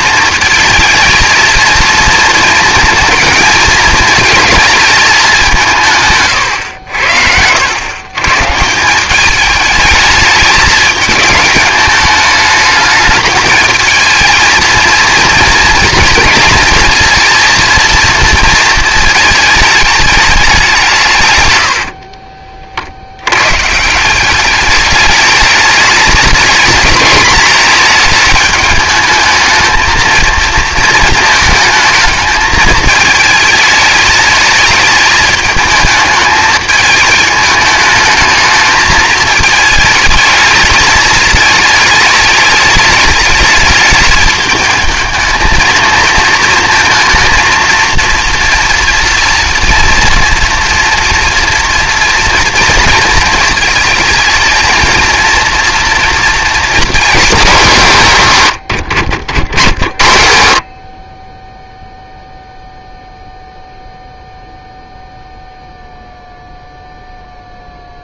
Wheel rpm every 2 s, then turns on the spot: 220, 220, 220, 100, 170, 220, 210, 230, 230, 220, 170, 40, 210, 220, 210, 220, 220, 210, 220, 220, 220, 210, 220, 230, 230, 230, 230, 220, 220, 100, 40, 0, 0, 0.
6-8 58-60